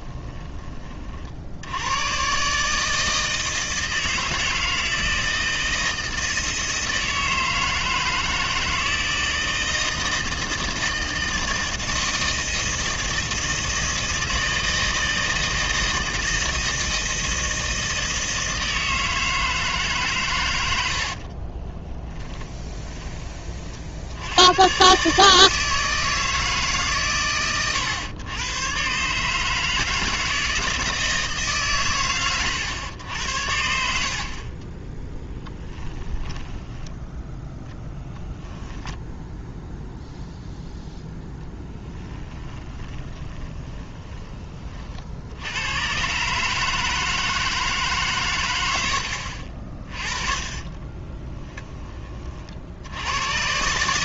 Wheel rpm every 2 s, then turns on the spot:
30, 150, 160, 160, 160, 160, 160, 160, 160, 160, 90, 20, 130, 150, 120, 160, 90, 20, 10, 0, 0, 20, 40, 150, 80, 20, 70.
20-22 34-36 42-44 50-52